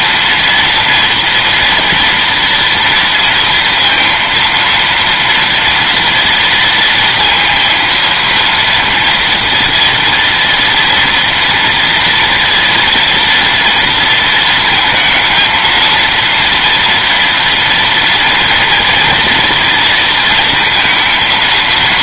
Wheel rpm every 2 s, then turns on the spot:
230, 230, 230, 230, 230, 230, 230, 220, 230, 230, 230.
none